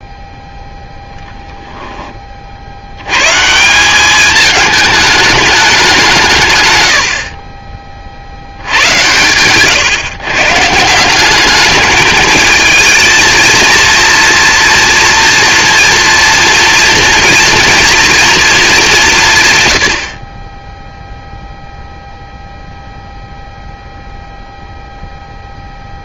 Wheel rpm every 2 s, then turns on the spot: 10, 160, 210, 20, 120, 200, 230, 230, 240, 130, 0, 0, 0.
none